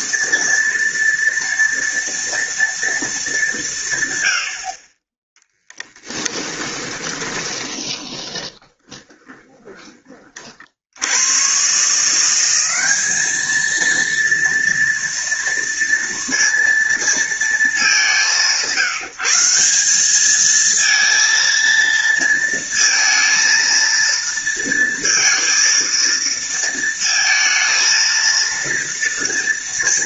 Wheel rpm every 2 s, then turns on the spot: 230, 230, 50, 20, 20, 60, 200, 230, 230, 170, 220, 230, 230, 230, 230.
6-10